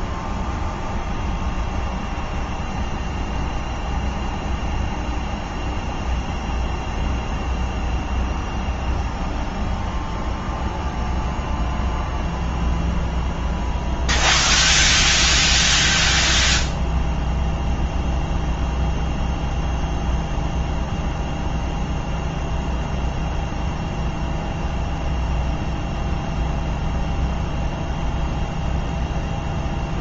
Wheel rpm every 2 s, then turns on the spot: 0, 0, 0, 0, 0, 0, 0, 0, 0, 0, 0, 0, 0, 0, 0.
none